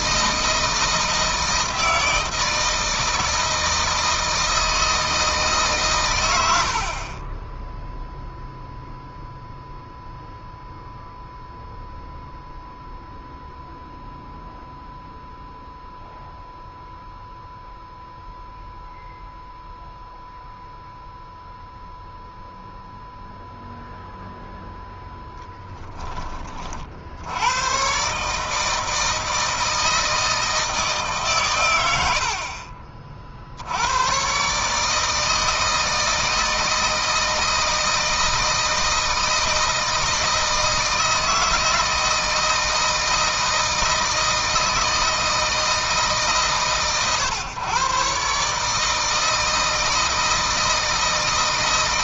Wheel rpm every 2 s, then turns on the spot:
160, 160, 160, 60, 0, 0, 0, 0, 0, 0, 0, 0, 0, 50, 160, 160, 50, 140, 160, 160, 160, 160, 160, 140, 150, 160.
none